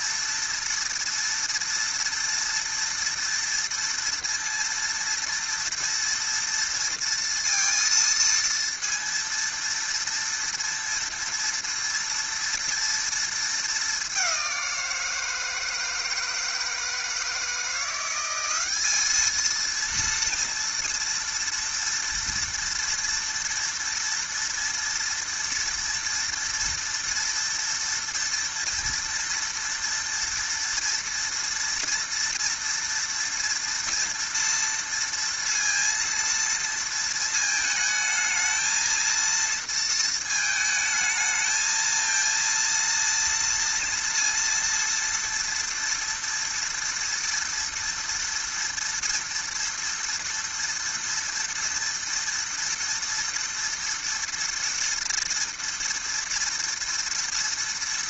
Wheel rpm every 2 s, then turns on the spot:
230, 230, 230, 230, 230, 230, 230, 190, 160, 190, 230, 230, 230, 230, 230, 230, 240, 230, 230, 220, 220, 230, 230, 230, 230, 230, 230, 230, 230.
none